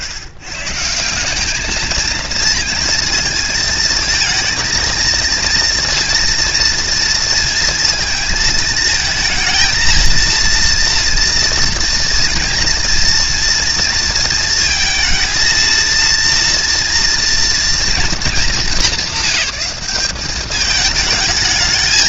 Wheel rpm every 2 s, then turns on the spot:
200, 230, 230, 230, 220, 230, 230, 220, 230, 200, 210.
none